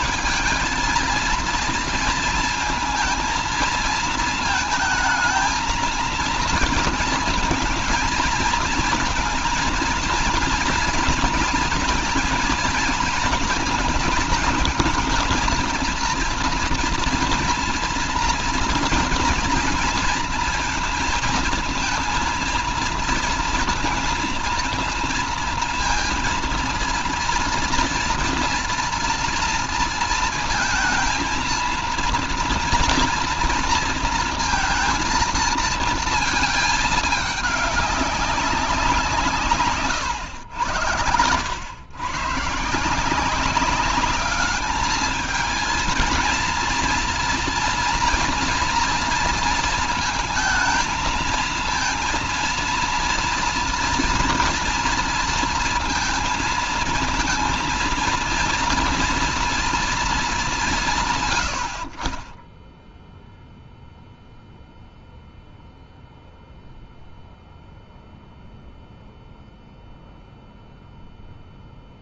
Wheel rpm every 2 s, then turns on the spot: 220, 230, 220, 230, 230, 230, 230, 230, 230, 230, 230, 230, 230, 230, 230, 220, 230, 230, 220, 190, 90, 140, 210, 230, 230, 220, 230, 230, 220, 230, 180, 10, 0, 0, 0, 0.
62-64